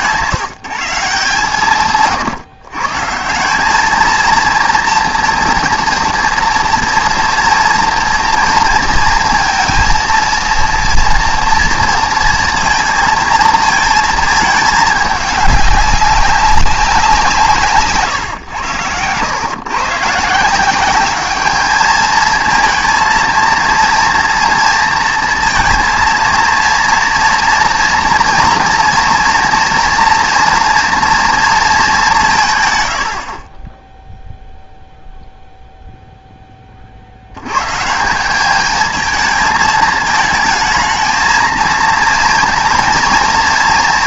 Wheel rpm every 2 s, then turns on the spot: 190, 140, 230, 230, 230, 230, 230, 220, 190, 100, 180, 220, 230, 230, 230, 230, 120, 0, 30, 210, 220, 230.
none